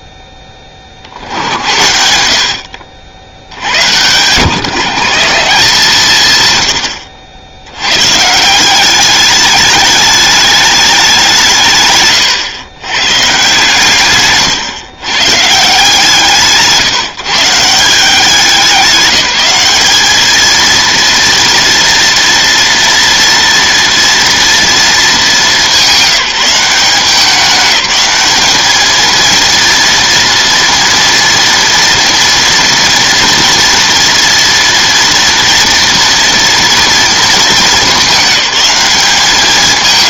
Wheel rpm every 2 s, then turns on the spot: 30, 60, 150, 100, 180, 210, 110, 150, 160, 190, 230, 230, 230, 190, 220, 230, 230, 230, 230, 200.
none